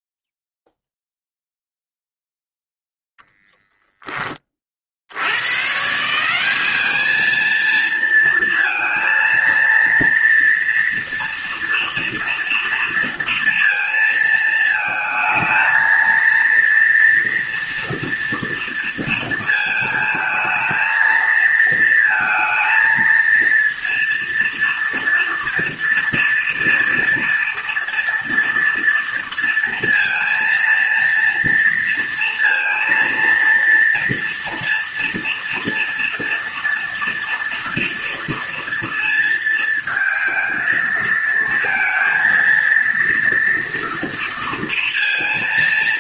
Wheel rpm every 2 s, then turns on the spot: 0, 0, 20, 180, 230, 230, 230, 220, 230, 230, 220, 230, 230, 230, 230, 230, 230, 230, 230, 230, 230, 230, 230.
none